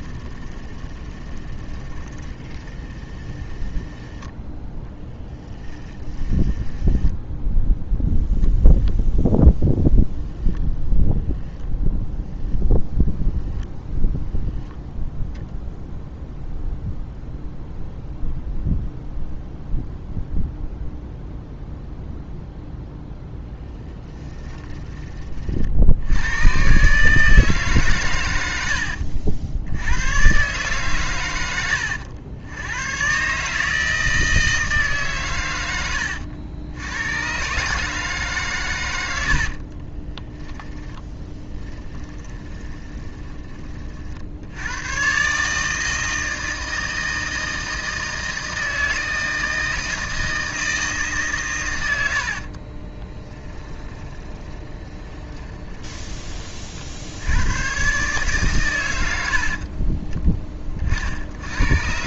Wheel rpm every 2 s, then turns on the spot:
10, 10, 10, 10, 0, 0, 0, 0, 0, 0, 0, 10, 30, 140, 70, 130, 110, 140, 100, 110, 10, 20, 110, 160, 160, 160, 40, 20, 50, 100, 40.
0-4 6-8 24-26 40-44 52-56